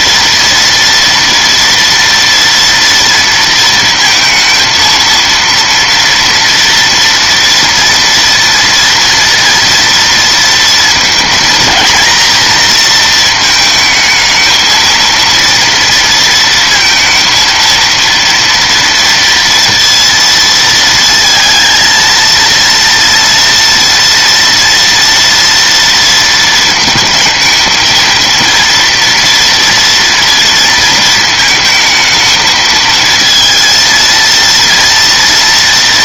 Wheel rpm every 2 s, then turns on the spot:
230, 230, 230, 230, 240, 230, 230, 220, 230, 230, 230, 230, 230, 230, 230, 230, 220, 230.
none